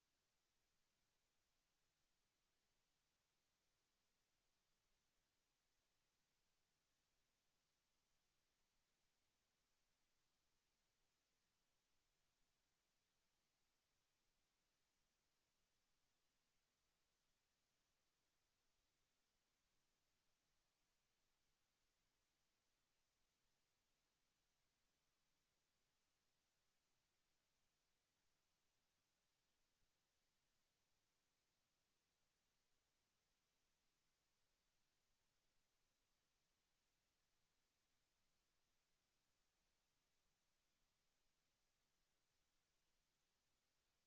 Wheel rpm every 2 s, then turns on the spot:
0, 0, 0, 0, 0, 0, 0, 0, 0, 0, 0, 0, 0, 0, 0, 0, 0, 0, 0, 0, 0, 0.
none